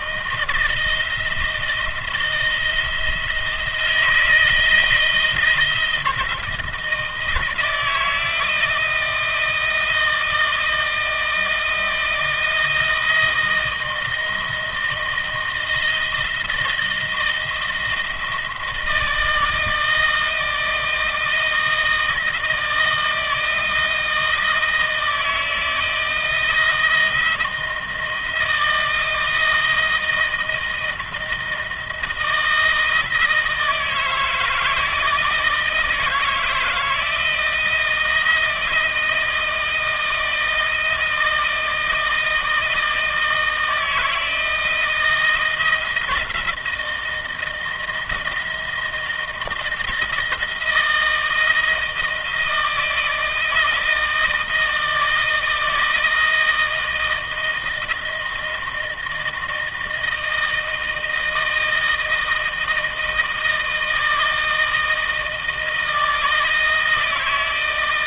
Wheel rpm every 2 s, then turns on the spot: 170, 160, 160, 160, 160, 160, 160, 160, 160, 160, 160, 160, 160, 160, 170, 160, 160, 160, 160, 170, 160, 160, 160, 170, 160, 160, 160, 160, 160, 160, 160, 160, 160, 160.
none